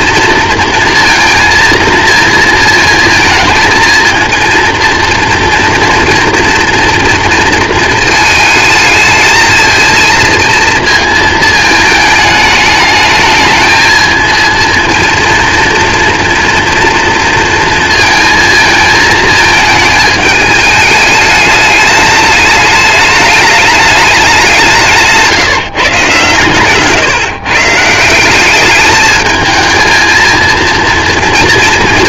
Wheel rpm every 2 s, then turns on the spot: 230, 220, 230, 230, 220, 230, 210, 230, 240, 220, 210, 210, 180, 140, 200, 230.
none